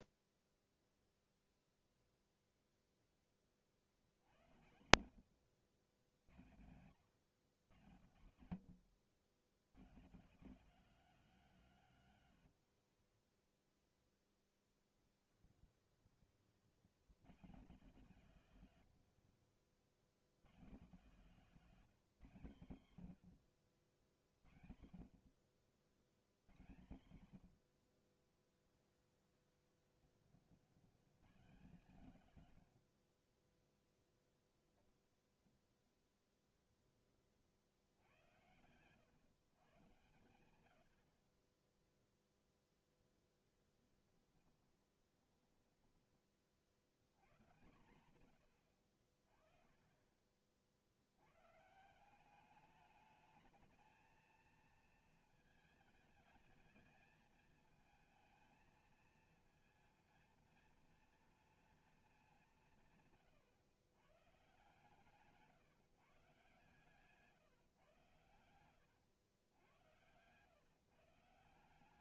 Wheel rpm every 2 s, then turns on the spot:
0, 0, 80, 100, 120, 220, 100, 10, 90, 120, 150, 140, 60, 100, 20, 100, 100, 0, 0, 100, 80, 0, 20, 50, 90, 50, 210, 230, 220, 220, 230, 160, 140, 140, 100, 140.
12-16 18-20 38-40 44-46 68-70